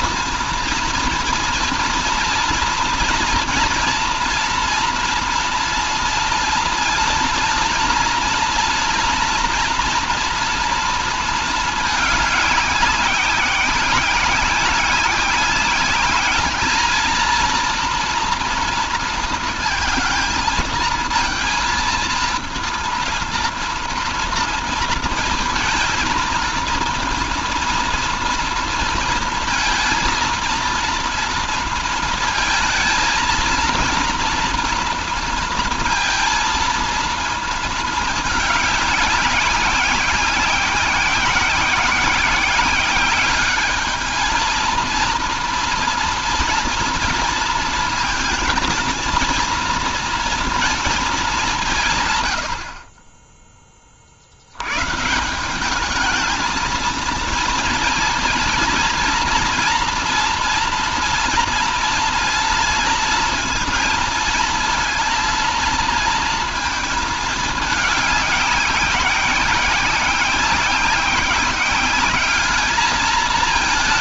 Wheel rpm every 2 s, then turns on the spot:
230, 230, 230, 230, 230, 230, 200, 190, 210, 230, 230, 230, 230, 230, 230, 230, 220, 230, 230, 200, 190, 190, 230, 230, 230, 220, 40, 120, 220, 230, 230, 230, 230, 220, 200, 190, 210.
none